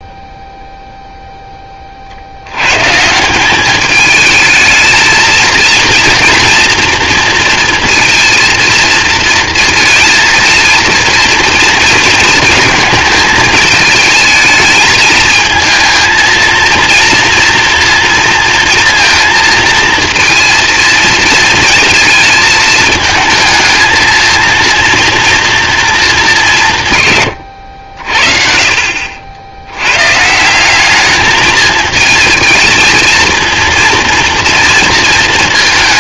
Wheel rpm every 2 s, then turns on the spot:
0, 110, 220, 230, 230, 230, 230, 220, 230, 230, 220, 220, 230, 150, 50, 170, 220, 230.
none